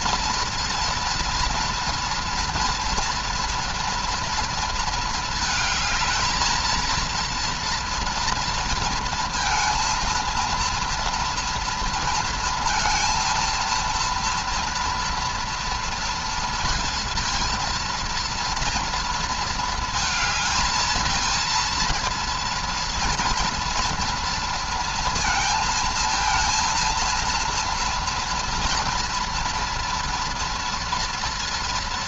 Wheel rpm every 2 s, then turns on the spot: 230, 230, 220, 220, 230, 230, 230, 230, 230, 230, 220, 230, 230, 230, 230, 230.
none